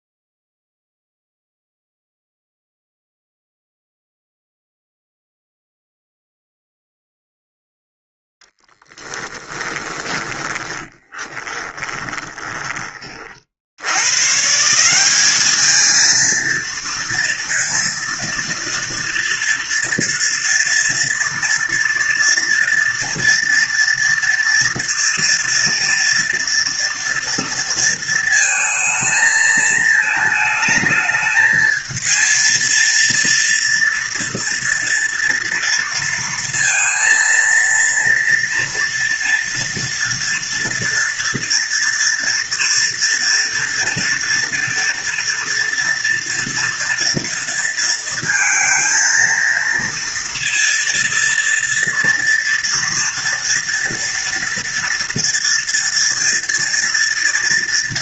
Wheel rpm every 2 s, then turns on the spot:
0, 0, 0, 0, 10, 10, 20, 180, 230, 230, 230, 230, 230, 230, 220, 220, 230, 230, 230, 230, 240, 240, 240, 230, 230, 230, 230, 230, 230.
10-12